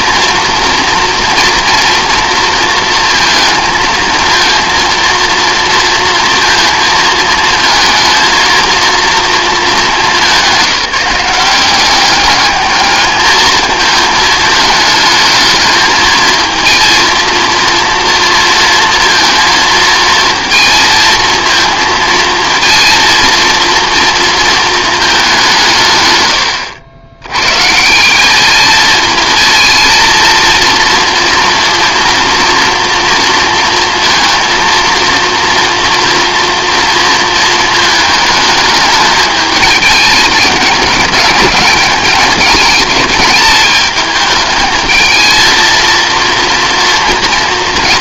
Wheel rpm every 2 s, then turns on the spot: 240, 230, 230, 230, 230, 180, 210, 220, 230, 230, 230, 230, 220, 90, 220, 230, 240, 230, 230, 210, 210, 220, 220, 230.
none